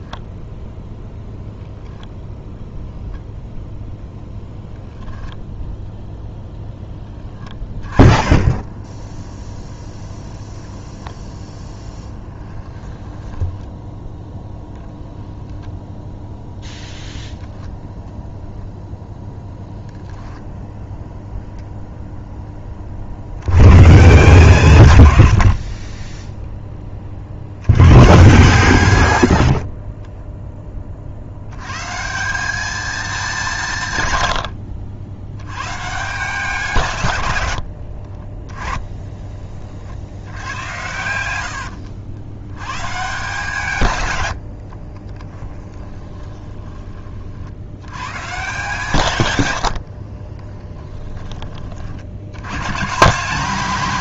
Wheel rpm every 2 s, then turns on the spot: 0, 0, 0, 10, 10, 0, 10, 0, 0, 0, 0, 30, 130, 10, 130, 30, 210, 80, 150, 10, 90, 130, 40, 20, 140, 10, 140.
12-14 44-46 50-52